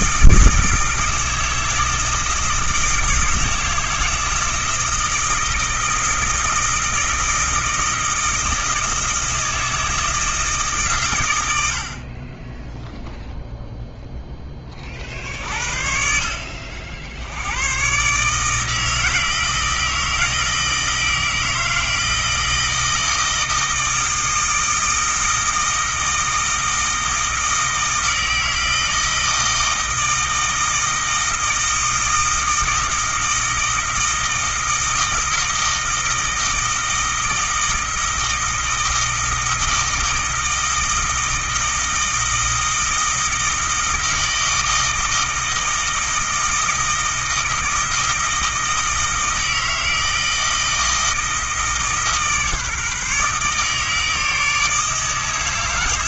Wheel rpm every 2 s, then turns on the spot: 160, 160, 160, 160, 160, 120, 0, 40, 60, 160, 160, 160, 160, 160, 160, 160, 160, 160, 160, 160, 160, 160, 160, 160, 160, 160, 150, 160.
none